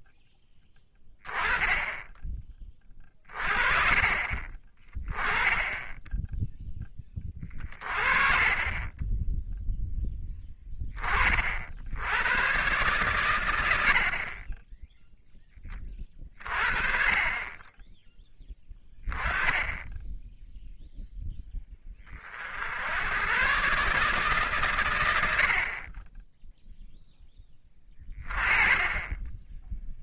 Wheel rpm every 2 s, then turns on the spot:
10, 20, 30, 0, 30, 20, 120, 20, 30, 10, 0, 70, 130, 0, 20.
none